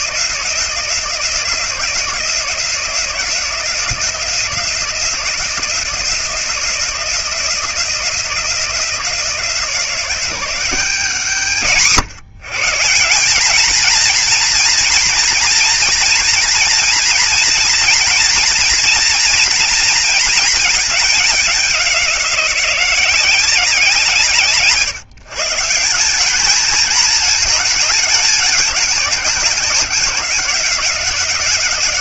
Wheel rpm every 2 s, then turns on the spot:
170, 170, 170, 170, 170, 130, 150, 230, 230, 240, 220, 180, 140, 220, 200, 180.
none